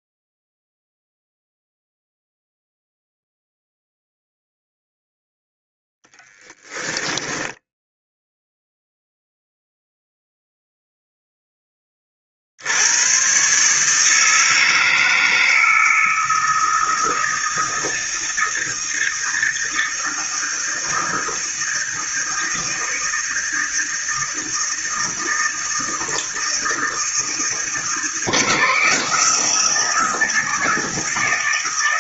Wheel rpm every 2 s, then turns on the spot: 0, 0, 0, 10, 0, 0, 110, 160, 160, 160, 160, 160, 160, 160, 160, 160.
6-8